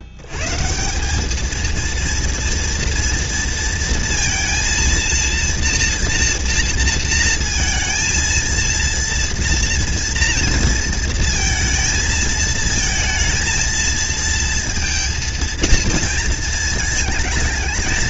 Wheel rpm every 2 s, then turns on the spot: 190, 230, 230, 230, 230, 230, 230, 230, 220.
none